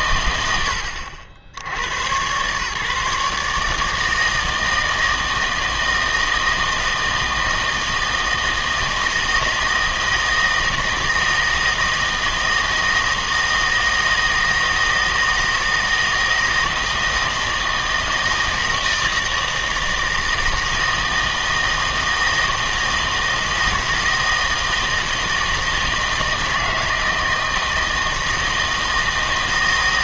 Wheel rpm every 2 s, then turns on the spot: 100, 140, 160, 160, 160, 160, 160, 160, 160, 160, 160, 160, 160, 170, 160.
none